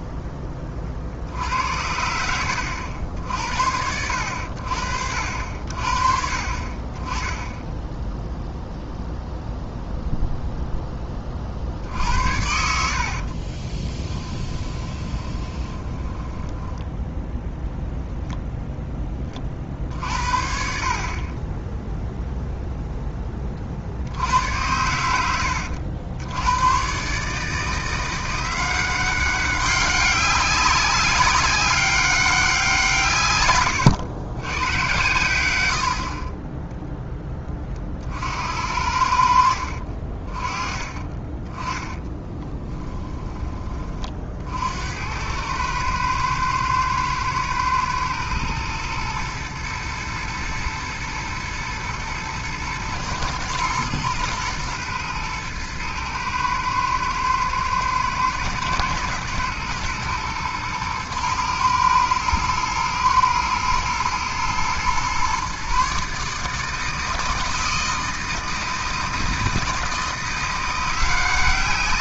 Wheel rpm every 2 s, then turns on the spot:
40, 70, 70, 20, 0, 20, 70, 20, 10, 10, 40, 0, 90, 110, 180, 200, 170, 110, 20, 70, 30, 20, 70, 110, 110, 110, 110, 120, 110, 110, 110, 120, 120, 160, 160, 170.
12-16 42-44